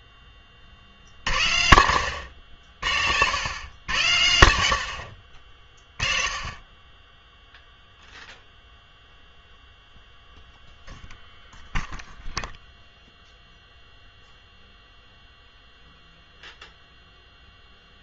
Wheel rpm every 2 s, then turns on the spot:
30, 70, 70, 30, 0, 0, 0, 0, 0.
none